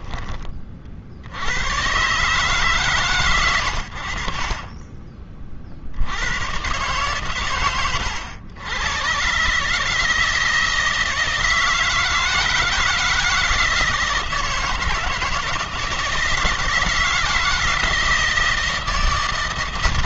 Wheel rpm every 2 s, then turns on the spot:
60, 130, 40, 130, 130, 160, 160, 160, 160, 160.
none